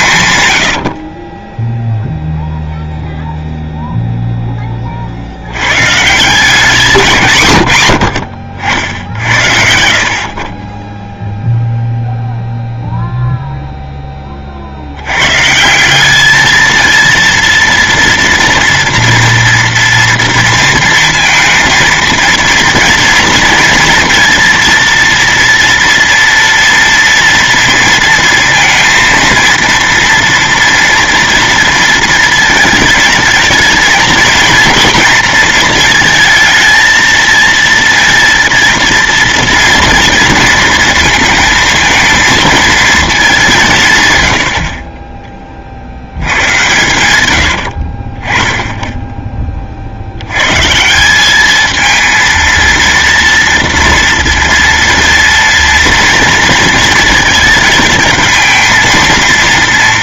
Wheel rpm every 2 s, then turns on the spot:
90, 0, 20, 180, 70, 20, 0, 50, 220, 230, 230, 230, 230, 230, 230, 230, 220, 230, 220, 230, 230, 220, 60, 100, 20, 130, 230, 230, 230, 220.
46-48